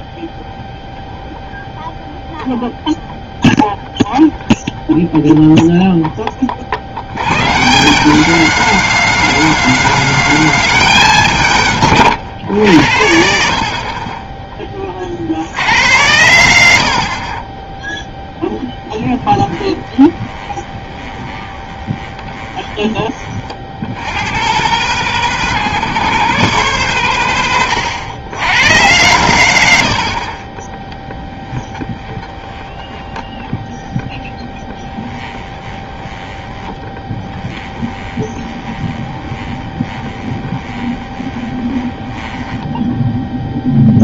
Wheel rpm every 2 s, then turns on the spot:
0, 0, 0, 30, 210, 210, 100, 20, 70, 10, 20, 20, 120, 150, 100, 20, 20, 20, 20, 20, 20, 10.
18-24 30-44